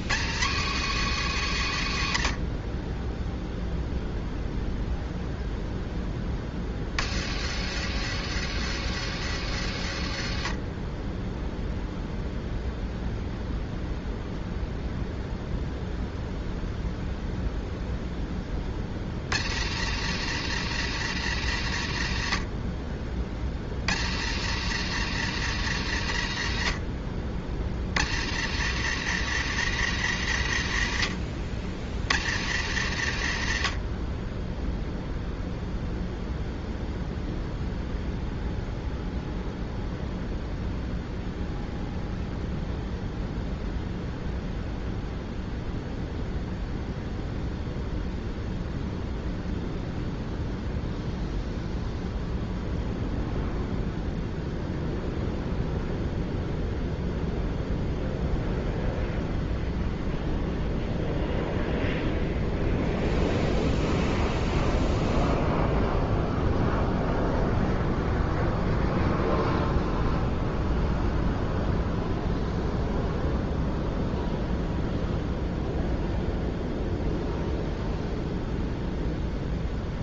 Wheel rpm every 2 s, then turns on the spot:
120, 30, 0, 40, 100, 30, 0, 0, 0, 30, 120, 40, 110, 50, 110, 80, 90, 0, 0, 0, 0, 0, 0, 0, 0, 0, 0, 0, 0, 0, 0, 0, 0, 0, 0, 0, 0, 0, 0, 0.
none